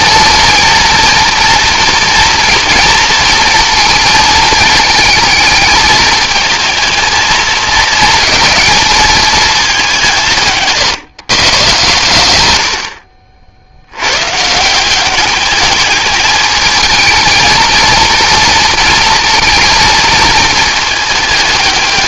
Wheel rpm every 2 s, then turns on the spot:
220, 230, 220, 220, 210, 150, 70, 170, 220, 220, 220.
none